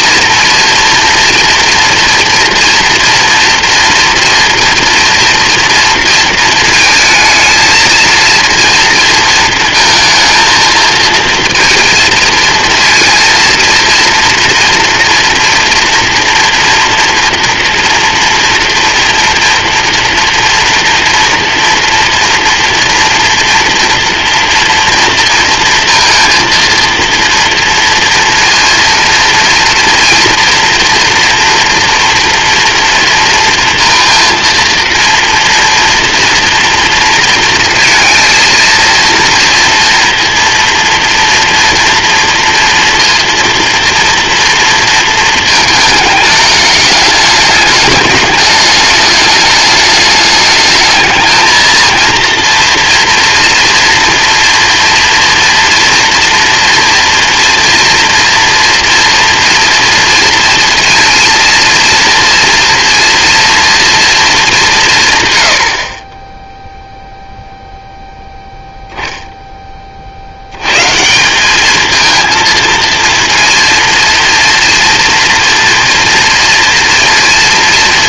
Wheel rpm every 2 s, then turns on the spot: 230, 230, 230, 230, 230, 220, 230, 230, 230, 230, 230, 230, 230, 230, 230, 230, 230, 230, 230, 230, 230, 230, 230, 210, 210, 210, 230, 230, 230, 230, 230, 230, 200, 0, 0, 100, 230, 230, 230.
none